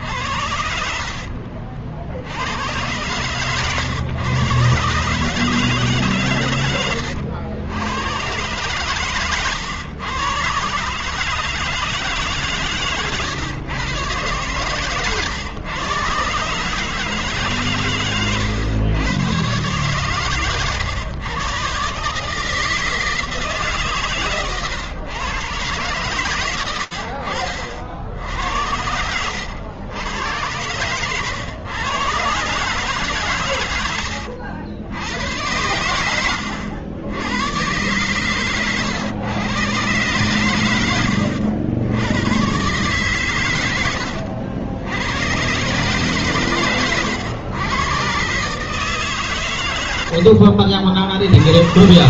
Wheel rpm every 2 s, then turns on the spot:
70, 60, 120, 140, 110, 110, 160, 130, 130, 140, 130, 140, 130, 130, 80, 100, 120, 100, 100, 120, 120, 90, 100, 130, 120, 90.
36-38 50-52